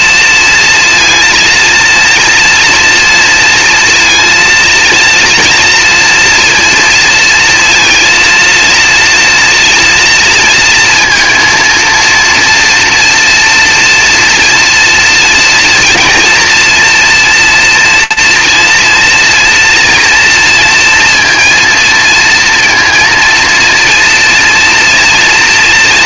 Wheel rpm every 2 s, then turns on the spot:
230, 230, 230, 230, 230, 230, 230, 240, 240, 240, 230, 230, 230.
none